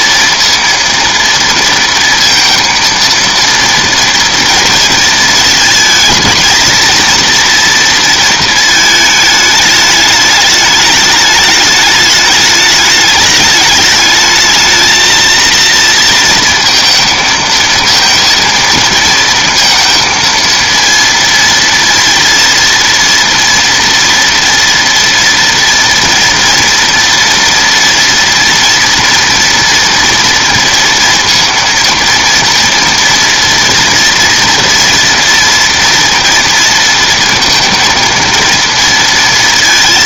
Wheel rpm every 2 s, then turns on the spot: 230, 230, 230, 220, 220, 210, 210, 220, 230, 230, 230, 230, 230, 230, 230, 230, 230, 230, 230, 230.
none